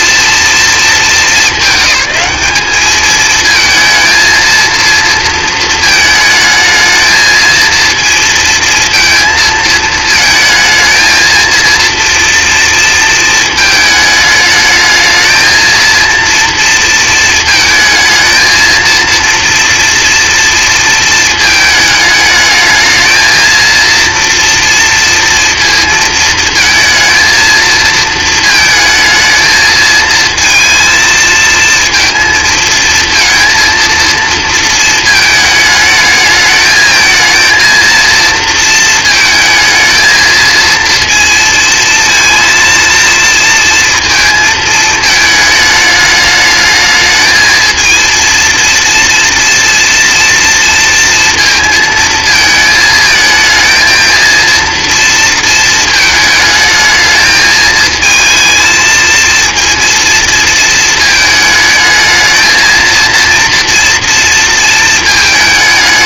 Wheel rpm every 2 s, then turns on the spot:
230, 210, 230, 220, 220, 220, 230, 220, 230, 230, 230, 220, 230, 220, 220, 230, 220, 230, 220, 230, 230, 230, 230, 220, 230, 230, 220, 230, 220, 220, 220, 220, 230.
none